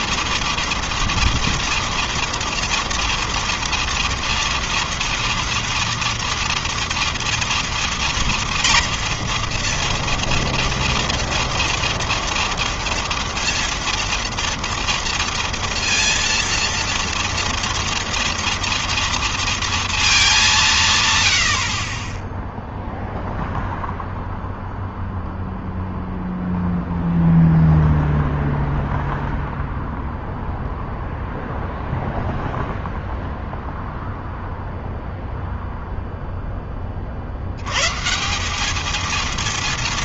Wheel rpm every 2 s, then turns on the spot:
240, 230, 230, 230, 240, 230, 230, 230, 230, 230, 120, 0, 0, 0, 0, 0, 0, 0, 50, 220.
none